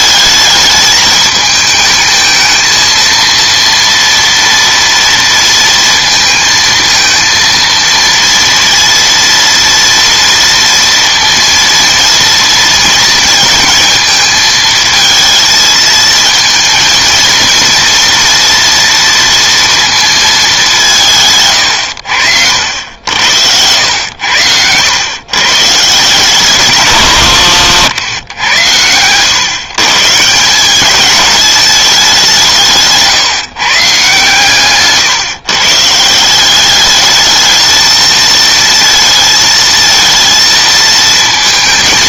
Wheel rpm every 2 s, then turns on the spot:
220, 220, 230, 230, 230, 230, 230, 220, 230, 230, 200, 70, 100, 160, 90, 180, 170, 140, 200, 230, 230.
none